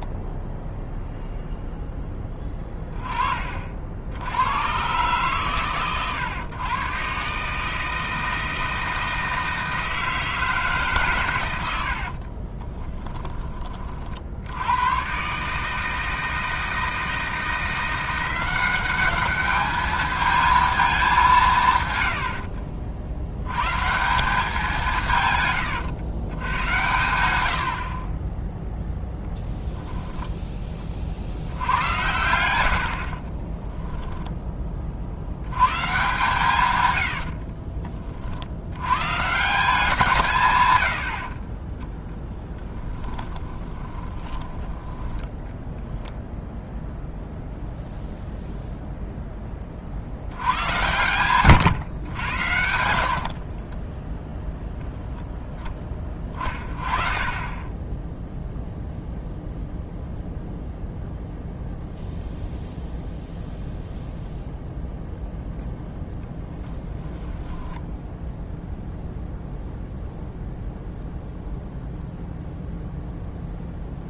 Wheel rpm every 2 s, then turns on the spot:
0, 20, 110, 120, 160, 150, 20, 100, 160, 190, 220, 60, 180, 110, 10, 20, 80, 30, 120, 110, 100, 10, 10, 0, 0, 100, 70, 10, 30, 0, 0, 0, 0, 10, 0, 0, 0.
12-14 32-34 36-38 42-46 66-68